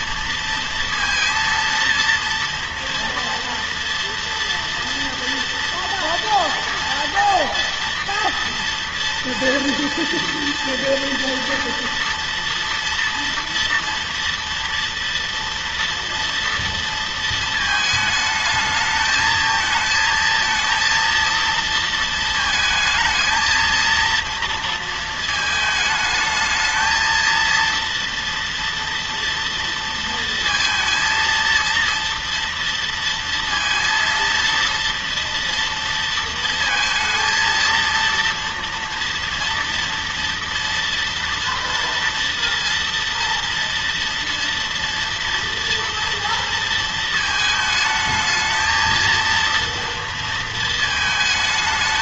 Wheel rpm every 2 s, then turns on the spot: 230, 230, 230, 230, 230, 230, 230, 230, 230, 220, 230, 220, 230, 220, 230, 230, 230, 230, 230, 230, 230, 230, 230, 230, 220, 230.
none